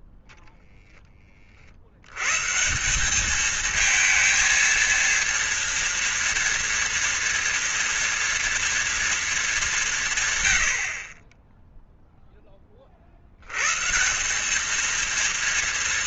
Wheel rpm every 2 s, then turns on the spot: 0, 140, 230, 230, 230, 110, 10, 200.
none